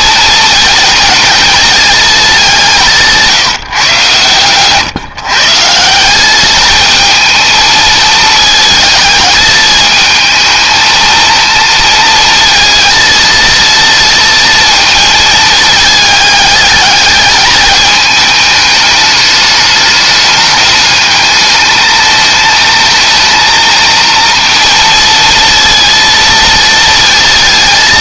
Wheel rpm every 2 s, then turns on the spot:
230, 160, 140, 220, 220, 220, 220, 230, 210, 210, 210, 220, 230, 230.
none